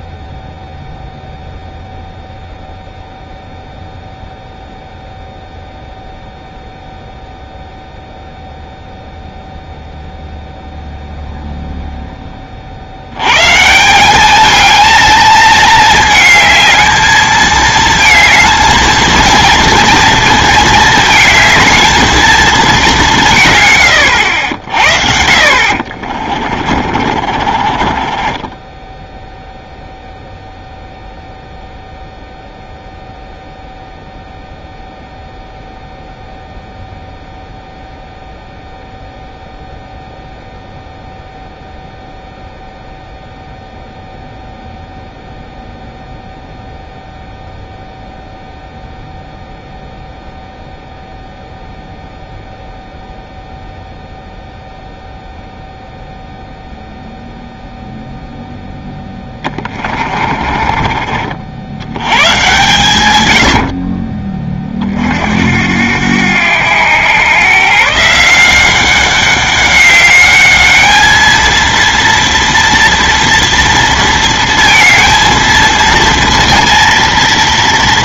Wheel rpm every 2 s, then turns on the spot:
0, 0, 0, 0, 0, 0, 50, 220, 220, 220, 220, 210, 60, 40, 10, 0, 0, 0, 0, 0, 0, 0, 0, 0, 0, 0, 0, 0, 0, 0, 40, 130, 30, 100, 180, 210, 230, 230, 230.
26-30 60-62